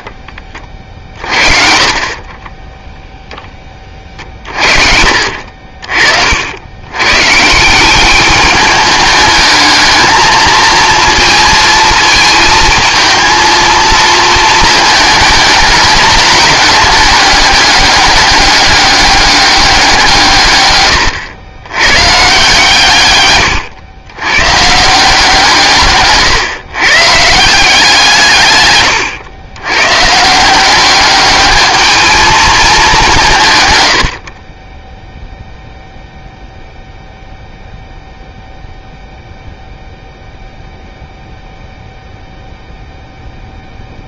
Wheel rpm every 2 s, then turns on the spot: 40, 0, 50, 110, 210, 230, 230, 220, 200, 200, 120, 130, 160, 140, 110, 200, 190, 10, 0, 0, 0, 0.
0-2 4-6 20-22 28-30 34-36